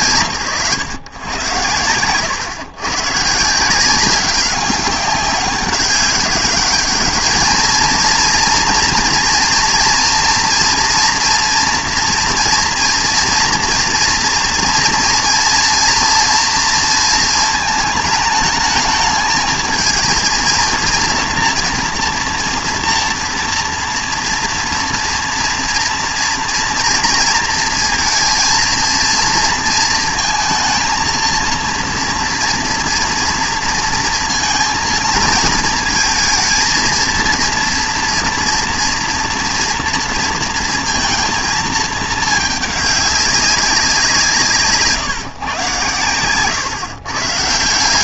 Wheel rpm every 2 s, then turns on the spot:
140, 120, 190, 200, 230, 230, 230, 240, 230, 210, 230, 230, 240, 230, 230, 230, 230, 230, 230, 230, 230, 210, 140, 100.
none